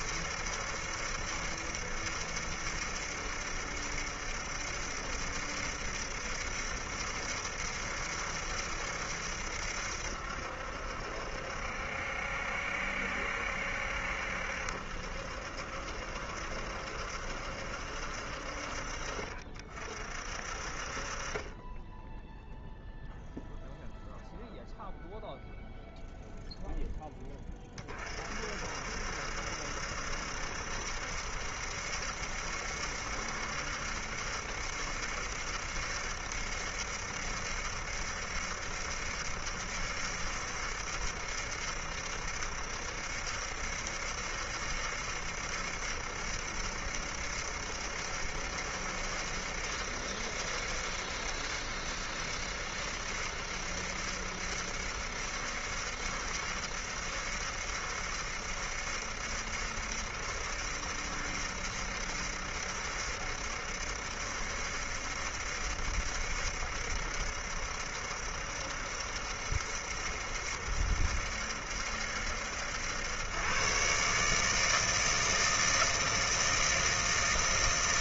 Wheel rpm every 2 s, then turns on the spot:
70, 70, 70, 70, 70, 70, 70, 70, 70, 50, 40, 0, 0, 10, 60, 70, 70, 70, 70, 70, 70, 70, 70, 70, 70, 70, 70, 70, 70, 70, 70, 70, 70, 70, 70, 70, 70, 150, 160.
none